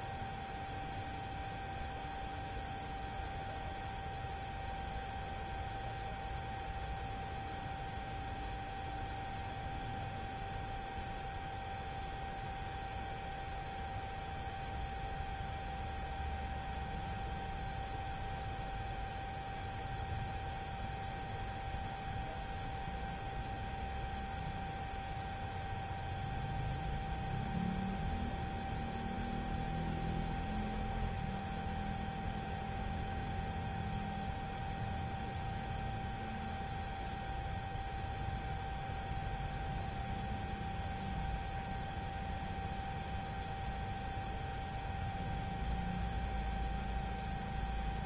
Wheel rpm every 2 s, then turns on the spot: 0, 0, 0, 0, 0, 0, 0, 0, 0, 0, 0, 0, 0, 0, 0, 0, 0, 0, 0, 0, 0, 0, 0, 0.
none